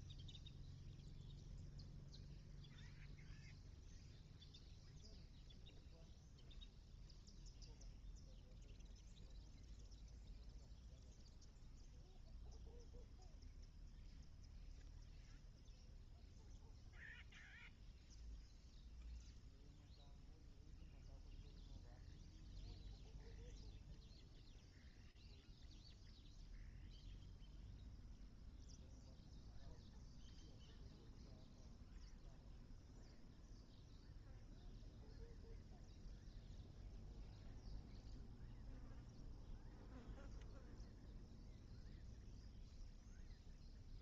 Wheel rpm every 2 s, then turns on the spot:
0, 0, 0, 0, 0, 0, 0, 0, 0, 0, 0, 0, 0, 0, 0, 0, 0, 0, 0, 0, 0, 0.
none